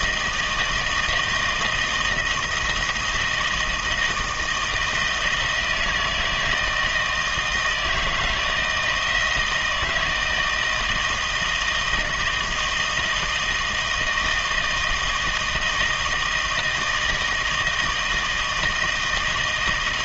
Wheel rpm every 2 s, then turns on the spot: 160, 170, 160, 160, 160, 160, 160, 160, 160, 160.
none